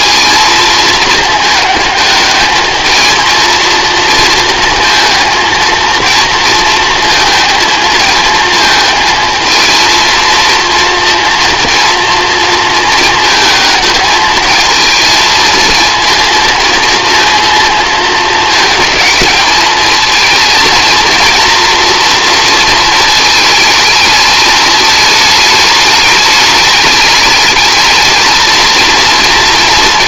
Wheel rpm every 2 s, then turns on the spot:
230, 220, 230, 230, 220, 230, 220, 220, 230, 210, 230, 230, 220, 210, 230.
none